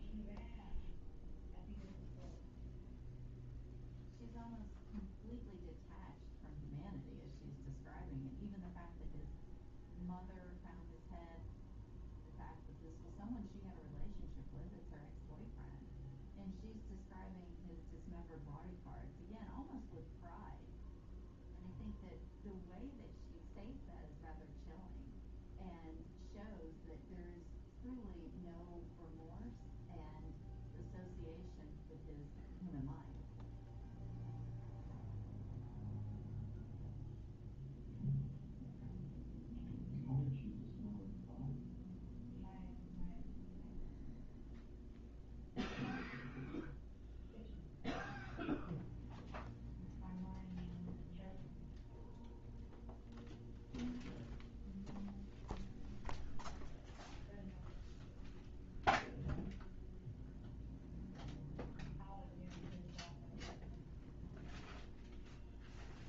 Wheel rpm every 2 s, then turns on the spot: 0, 0, 0, 0, 0, 0, 0, 0, 0, 0, 0, 0, 0, 0, 0, 0, 0, 0, 0, 0, 0, 0, 0, 0, 0, 0, 0, 0, 0, 0, 0, 0, 0.
none